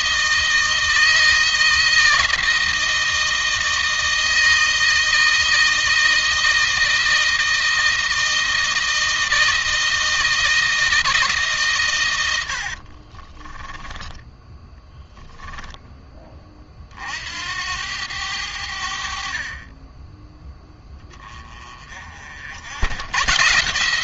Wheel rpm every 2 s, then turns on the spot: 160, 160, 160, 160, 160, 160, 50, 10, 40, 60, 10, 100.
12-16